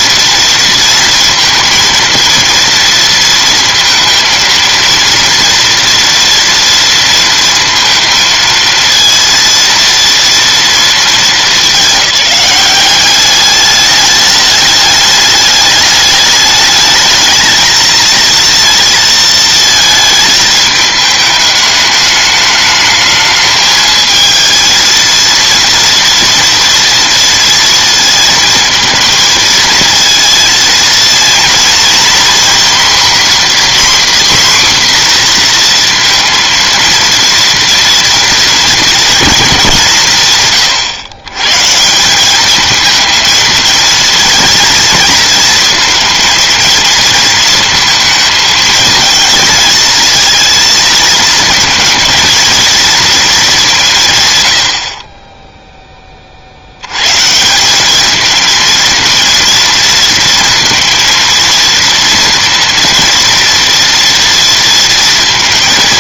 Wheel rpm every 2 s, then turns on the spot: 230, 230, 230, 230, 230, 220, 200, 210, 220, 230, 210, 220, 230, 230, 220, 230, 250, 260, 230, 230, 120, 220, 230, 230, 220, 230, 230, 40, 120, 230, 230, 230, 230.
none